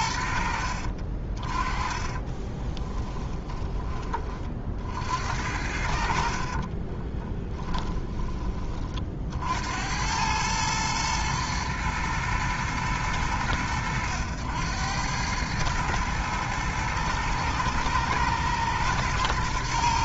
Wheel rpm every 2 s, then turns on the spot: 40, 10, 60, 30, 40, 110, 110, 100, 110, 110.
0-4 6-8